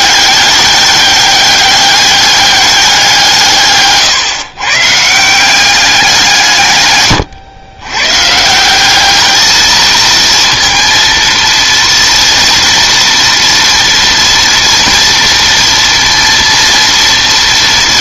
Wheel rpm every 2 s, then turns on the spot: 200, 200, 150, 150, 170, 230, 230, 230, 230.
none